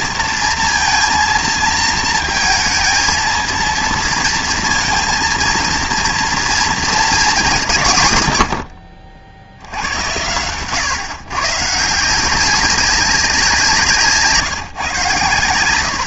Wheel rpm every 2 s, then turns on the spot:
230, 230, 230, 230, 80, 110, 190, 150.
none